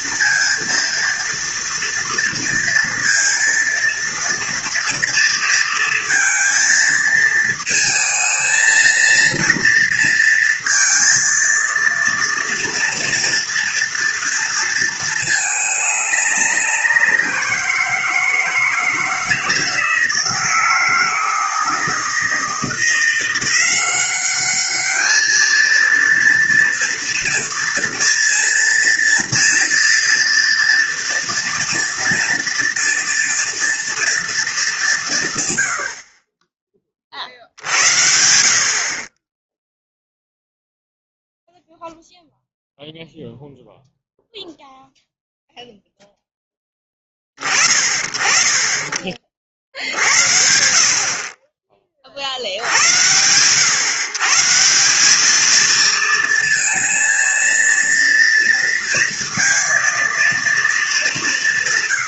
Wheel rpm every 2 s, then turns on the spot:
230, 230, 230, 230, 230, 230, 230, 230, 190, 160, 160, 170, 200, 230, 230, 230, 230, 190, 40, 50, 0, 0, 0, 10, 20, 60, 80, 170, 230, 230, 230.
none